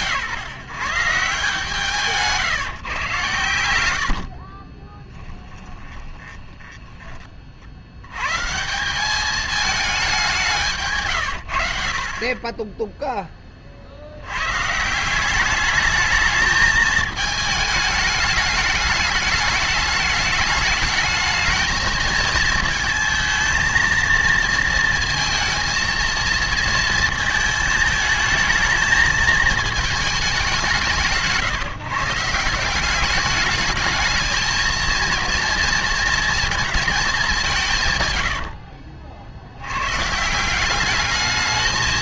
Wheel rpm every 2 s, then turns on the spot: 140, 150, 40, 10, 170, 160, 10, 130, 220, 210, 210, 230, 230, 230, 220, 160, 180, 230, 230, 70, 190.
4-6 38-40